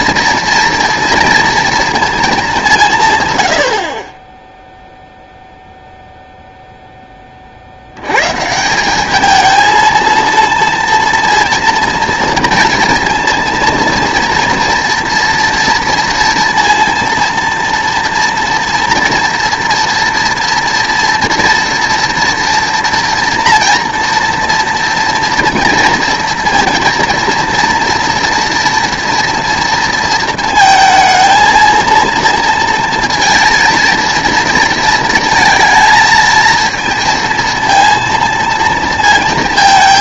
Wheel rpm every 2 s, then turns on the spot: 230, 180, 0, 0, 170, 230, 230, 230, 230, 230, 230, 240, 240, 230, 230, 220, 230, 220, 230, 230.
none